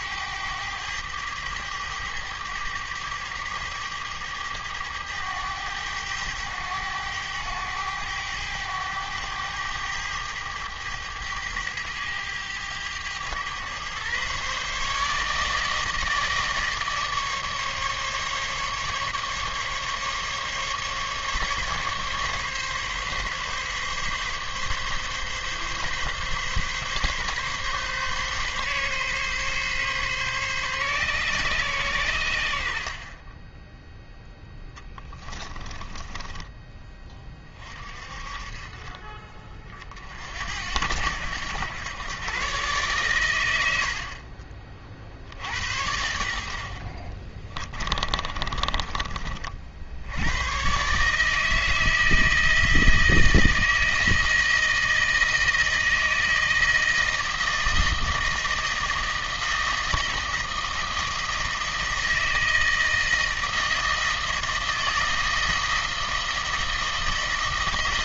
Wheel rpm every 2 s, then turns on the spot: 100, 100, 110, 100, 100, 100, 100, 140, 150, 140, 140, 140, 140, 130, 130, 140, 80, 10, 20, 40, 70, 130, 40, 70, 30, 120, 160, 160, 160, 160, 160, 160, 160, 160.
34-38 48-50